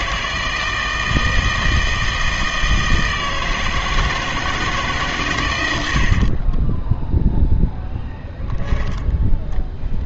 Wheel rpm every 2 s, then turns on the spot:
160, 160, 160, 10, 0.
6-8